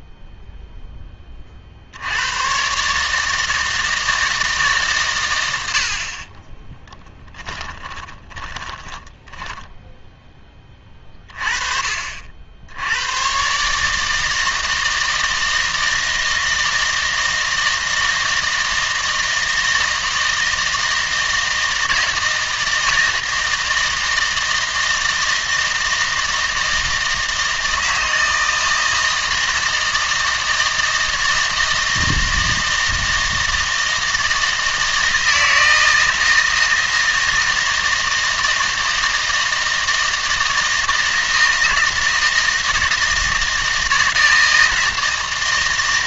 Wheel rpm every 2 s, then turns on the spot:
0, 120, 150, 20, 20, 20, 70, 160, 160, 160, 160, 170, 160, 160, 160, 160, 160, 160, 160, 160, 160, 160, 160.
6-10